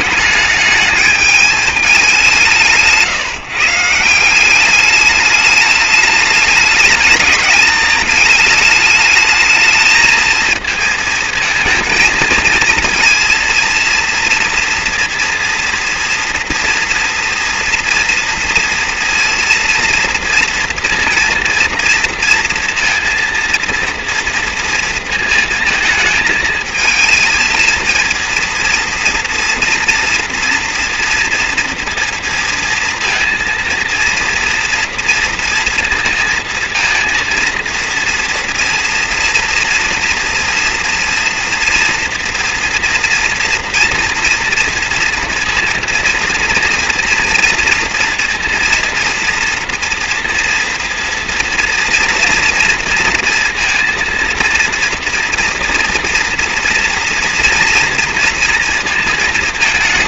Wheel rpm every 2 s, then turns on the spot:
210, 170, 200, 210, 210, 220, 230, 230, 230, 230, 230, 230, 230, 220, 230, 230, 230, 230, 230, 230, 230, 230, 230, 230, 230, 240, 230, 230, 230, 230.
none